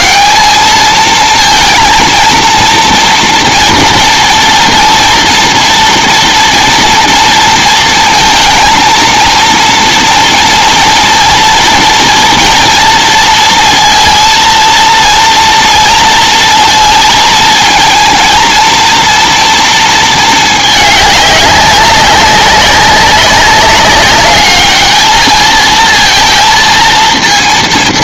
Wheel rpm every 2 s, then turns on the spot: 220, 230, 230, 240, 230, 230, 230, 230, 230, 230, 210, 190, 210, 230.
none